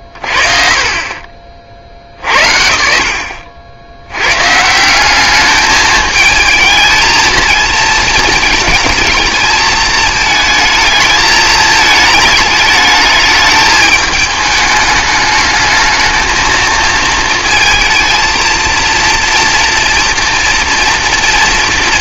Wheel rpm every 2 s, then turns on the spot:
30, 80, 180, 230, 220, 220, 220, 210, 220, 230, 240.
none